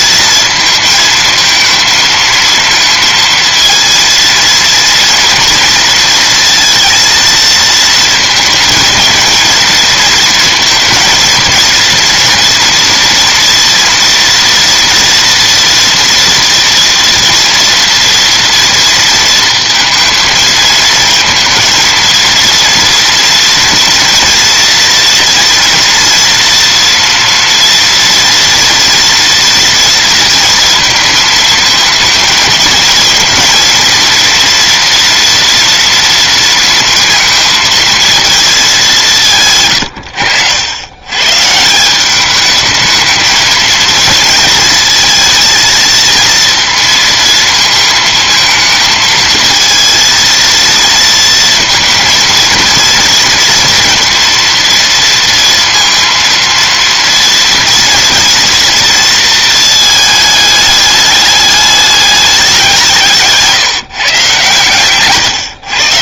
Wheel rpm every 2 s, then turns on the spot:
230, 230, 230, 230, 220, 230, 230, 230, 230, 230, 220, 230, 230, 230, 230, 220, 230, 230, 230, 180, 100, 220, 230, 230, 220, 230, 230, 230, 230, 230, 210, 180, 140.
none